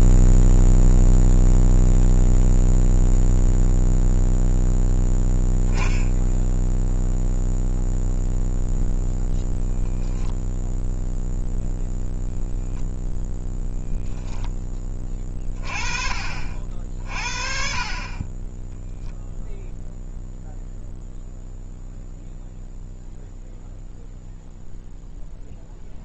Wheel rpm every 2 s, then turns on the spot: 0, 0, 0, 0, 0, 0, 0, 20, 50, 0, 0, 0, 0.
none